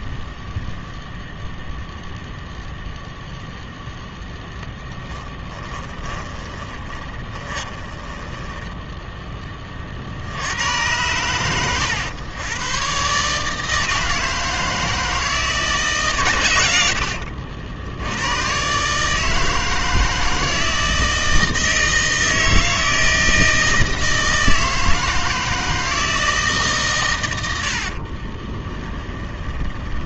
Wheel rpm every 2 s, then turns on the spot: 0, 0, 10, 20, 10, 90, 120, 160, 90, 130, 160, 160, 160, 150, 20.
6-10 28-30